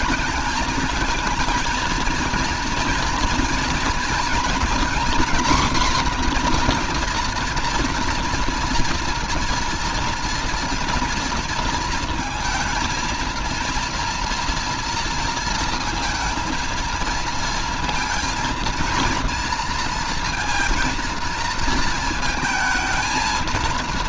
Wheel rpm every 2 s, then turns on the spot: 220, 230, 230, 240, 230, 230, 230, 230, 230, 230, 230, 220.
none